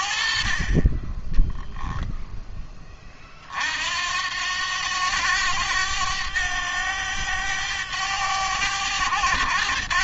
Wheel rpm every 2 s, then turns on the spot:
20, 30, 90, 100, 100.
0-2